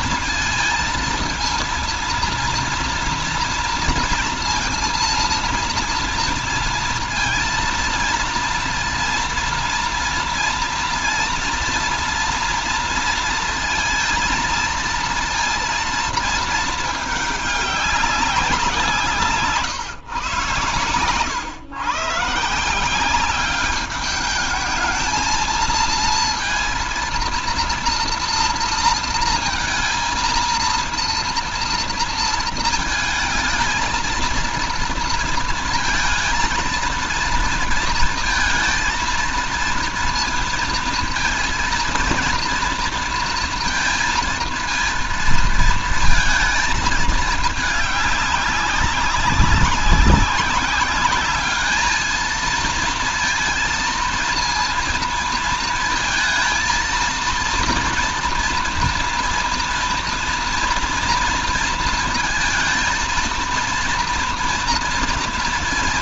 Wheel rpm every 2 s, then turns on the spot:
230, 230, 230, 230, 230, 230, 230, 230, 220, 180, 110, 150, 220, 230, 230, 230, 230, 230, 230, 230, 230, 230, 230, 220, 200, 190, 220, 230, 220, 230, 230, 220, 230.
none